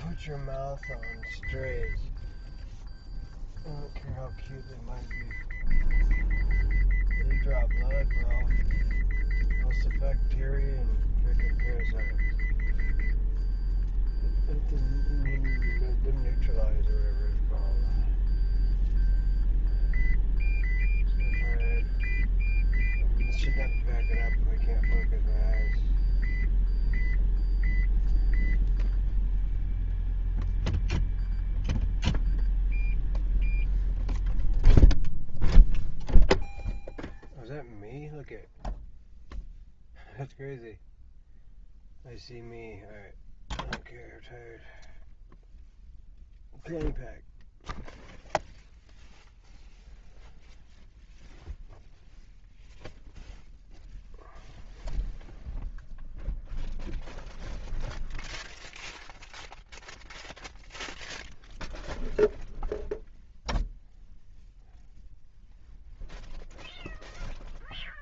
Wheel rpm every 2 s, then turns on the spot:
0, 0, 0, 0, 0, 0, 0, 0, 0, 0, 0, 0, 0, 0, 0, 0, 0, 0, 0, 0, 0, 0, 0, 0, 0, 0, 0, 0, 0, 0, 0, 0, 0, 0.
none